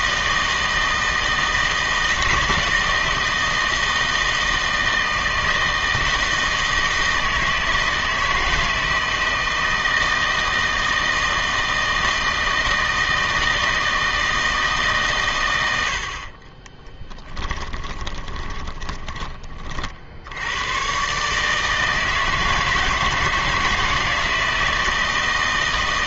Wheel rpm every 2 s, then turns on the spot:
160, 160, 160, 160, 160, 160, 160, 150, 20, 20, 110, 160, 160.
16-20